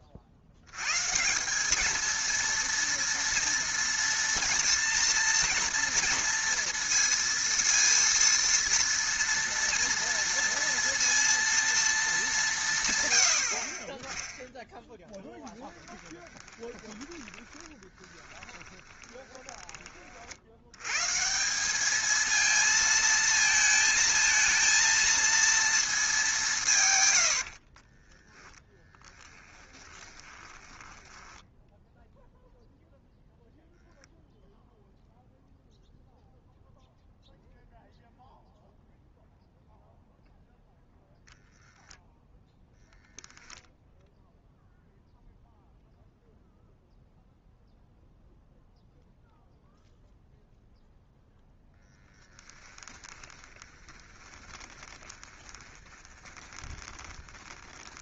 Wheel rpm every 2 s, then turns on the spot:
60, 230, 230, 230, 230, 230, 140, 10, 20, 20, 90, 220, 230, 170, 20, 20, 0, 0, 0, 0, 0, 0, 0, 0, 0, 0, 10, 20, 20.
16-20 28-32 52-58